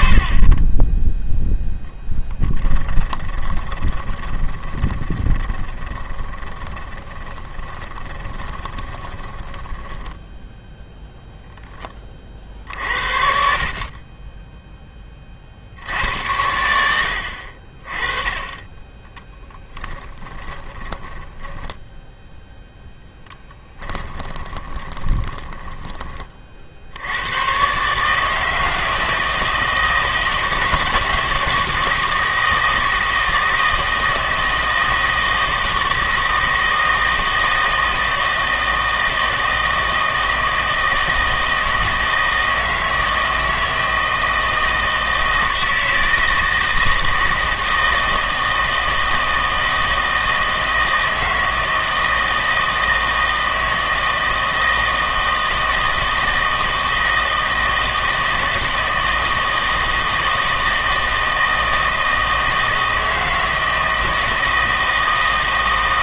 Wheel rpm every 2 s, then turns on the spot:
20, 10, 20, 20, 20, 0, 50, 10, 80, 20, 20, 0, 20, 70, 160, 160, 160, 160, 160, 160, 160, 160, 160, 160, 160, 160, 160, 160, 160, 160, 160, 160, 160.
2-10 18-22 24-26